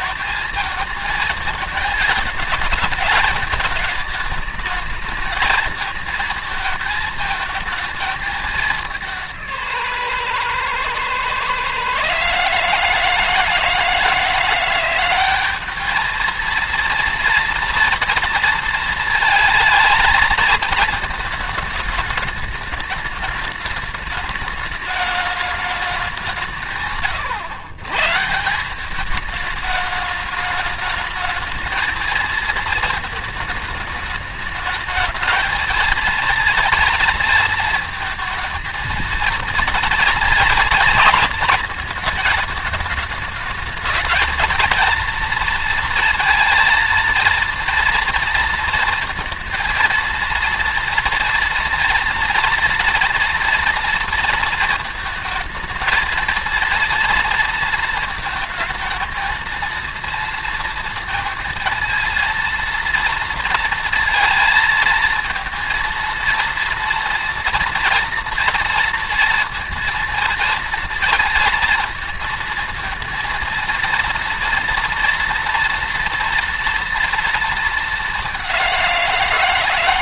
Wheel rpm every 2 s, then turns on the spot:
230, 220, 220, 220, 210, 120, 150, 170, 230, 230, 220, 210, 210, 170, 160, 210, 220, 220, 230, 230, 230, 220, 230, 230, 230, 230, 230, 230, 230, 230, 230, 230, 230, 230, 230, 230, 230, 240, 230, 190.
none